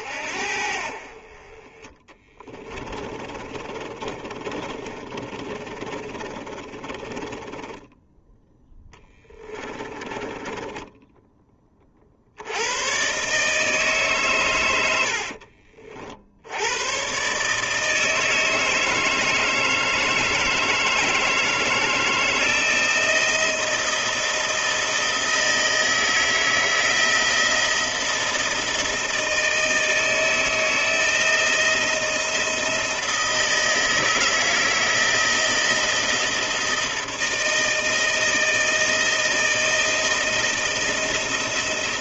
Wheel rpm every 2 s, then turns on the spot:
50, 20, 30, 20, 10, 10, 110, 90, 110, 160, 160, 170, 170, 160, 160, 160, 160, 160, 160, 160, 170.
2-12